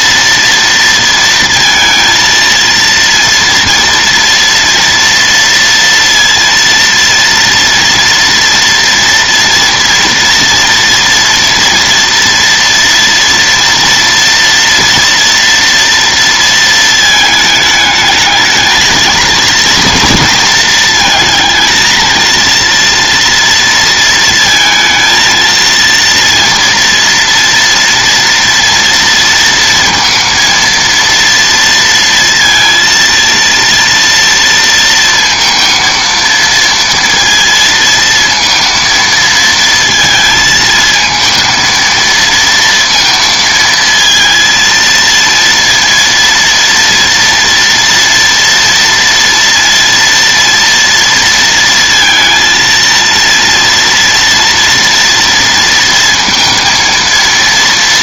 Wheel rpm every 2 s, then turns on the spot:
230, 230, 230, 230, 230, 230, 230, 230, 230, 220, 220, 230, 220, 230, 230, 230, 230, 230, 230, 230, 220, 230, 230, 230, 230, 230, 230, 230, 230.
none